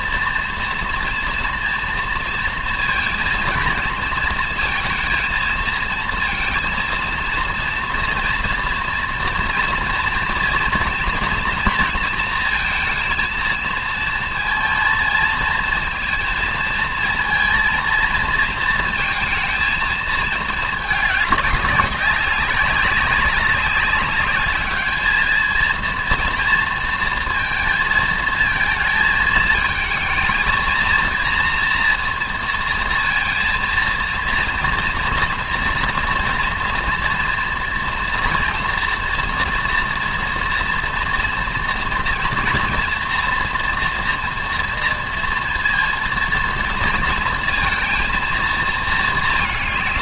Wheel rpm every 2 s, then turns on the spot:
230, 230, 230, 230, 230, 240, 230, 230, 230, 230, 210, 190, 210, 230, 220, 230, 230, 230, 230, 230, 230, 230, 230, 230, 230.
none